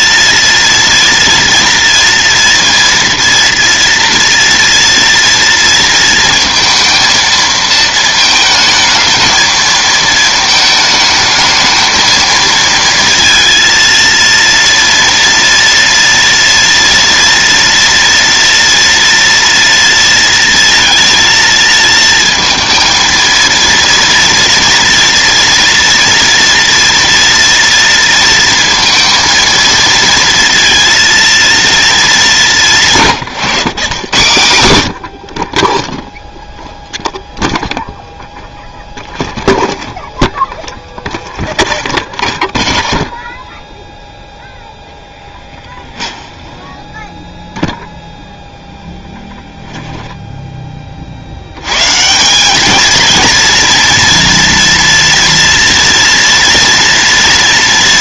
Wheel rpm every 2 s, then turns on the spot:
230, 230, 240, 230, 220, 220, 230, 230, 230, 230, 230, 230, 240, 230, 230, 230, 190, 100, 0, 0, 0, 0, 0, 10, 0, 10, 190, 230, 230.
46-48